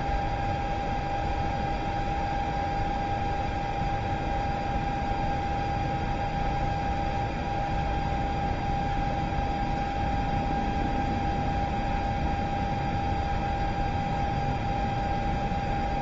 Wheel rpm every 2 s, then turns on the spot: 0, 0, 0, 0, 0, 0, 0, 0.
none